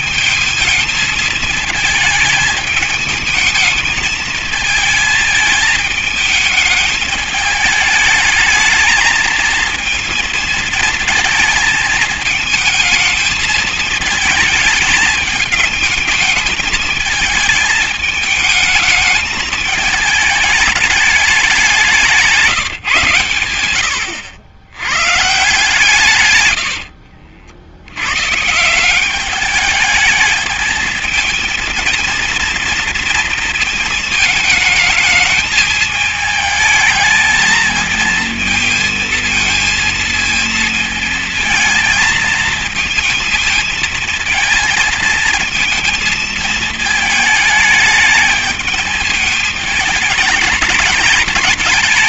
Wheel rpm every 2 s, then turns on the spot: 220, 220, 220, 210, 210, 230, 220, 220, 210, 220, 220, 150, 90, 110, 140, 220, 230, 230, 220, 230, 220, 230, 230, 220, 210, 220.
26-28